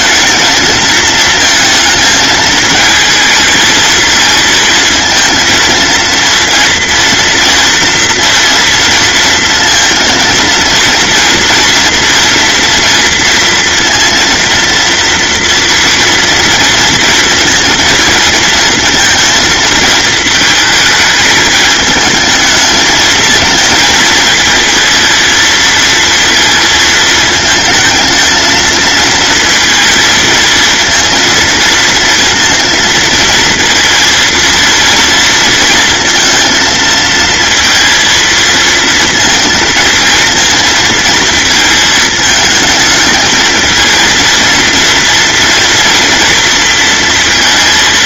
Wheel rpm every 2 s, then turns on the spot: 230, 220, 230, 230, 230, 230, 230, 230, 230, 230, 220, 220, 230, 230, 230, 230, 230, 230, 230, 230, 230, 210, 230, 230.
none